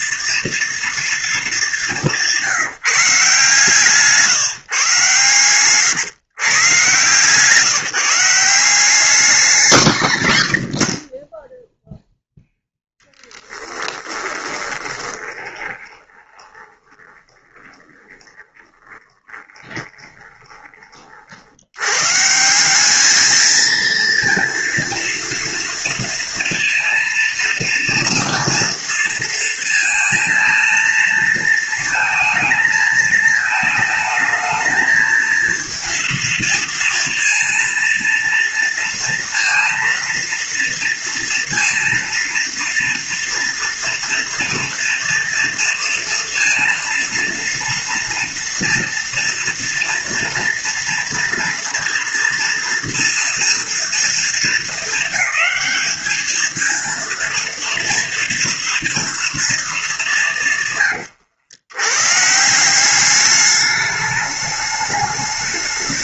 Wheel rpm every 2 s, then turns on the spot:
230, 160, 140, 130, 180, 60, 10, 20, 20, 20, 20, 170, 230, 230, 230, 230, 220, 220, 230, 230, 230, 230, 230, 230, 230, 230, 230, 230, 230, 230, 160, 170, 210.
14-20